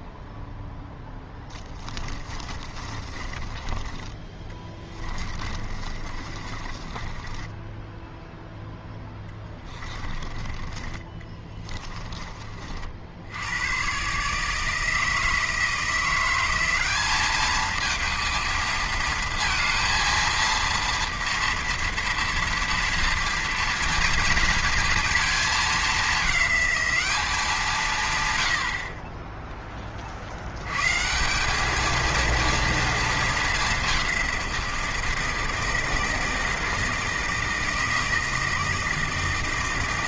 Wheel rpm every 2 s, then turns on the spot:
0, 20, 20, 30, 0, 30, 40, 160, 190, 230, 230, 230, 230, 210, 80, 90, 230, 170, 160, 160.
2-8